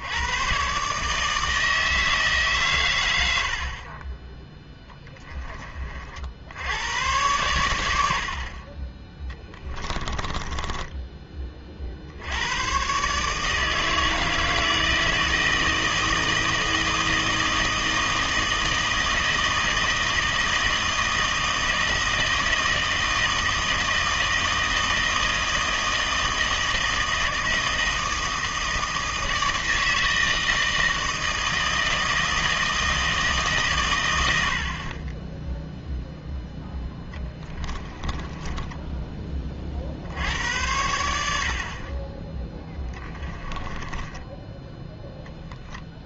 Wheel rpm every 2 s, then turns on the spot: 120, 130, 10, 90, 30, 20, 110, 160, 160, 160, 160, 160, 160, 160, 160, 160, 160, 60, 0, 20, 80, 10, 10.
8-12 38-40 42-44